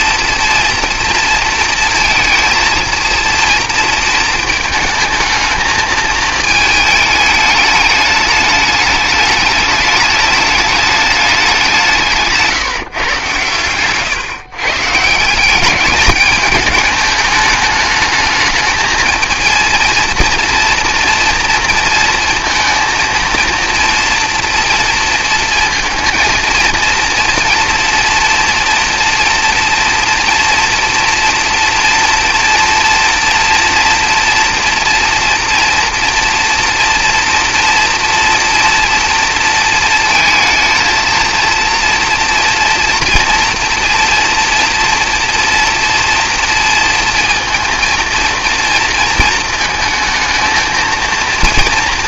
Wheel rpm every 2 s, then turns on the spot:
230, 230, 220, 220, 210, 210, 150, 140, 210, 220, 230, 230, 230, 230, 240, 230, 230, 230, 230, 230, 220, 230, 230, 230, 230, 230.
none